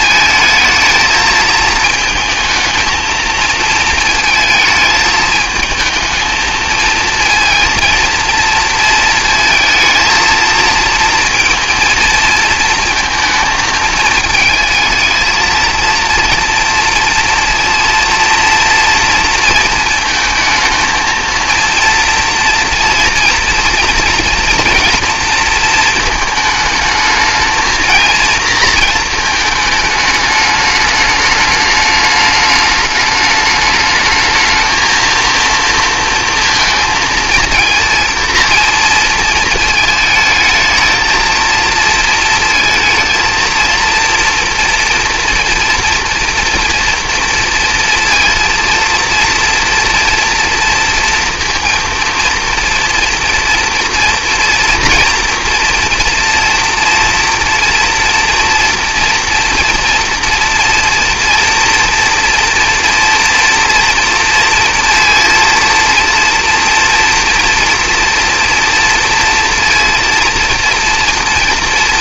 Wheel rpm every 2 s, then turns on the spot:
220, 220, 220, 220, 230, 230, 230, 220, 230, 230, 220, 230, 230, 220, 230, 210, 210, 220, 230, 230, 220, 230, 240, 240, 230, 230, 230, 230, 230, 230, 230, 240, 230, 230, 240, 230.
none